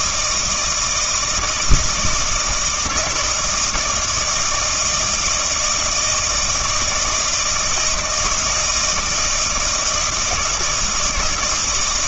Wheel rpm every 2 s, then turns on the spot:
160, 160, 160, 160, 160, 170.
none